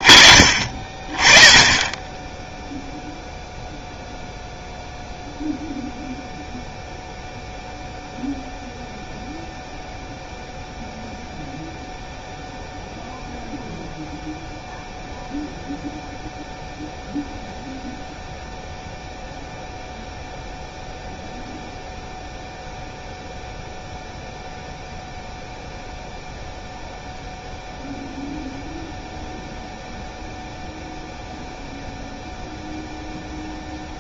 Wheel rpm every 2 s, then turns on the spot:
30, 0, 0, 0, 0, 0, 0, 0, 0, 0, 0, 0, 0, 0, 0, 0, 0.
none